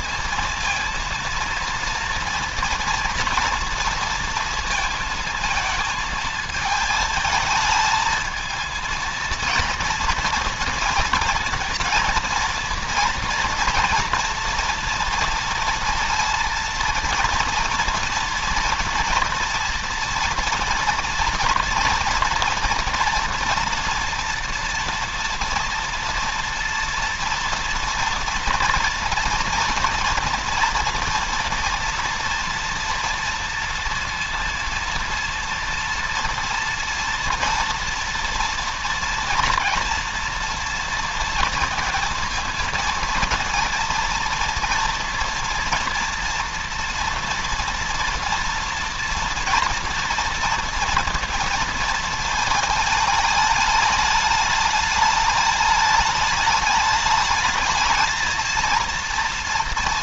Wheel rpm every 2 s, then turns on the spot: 230, 230, 230, 220, 220, 230, 230, 230, 230, 230, 230, 240, 240, 230, 230, 230, 230, 230, 230, 230, 230, 230, 230, 230, 240, 230, 220, 210, 210, 230.
none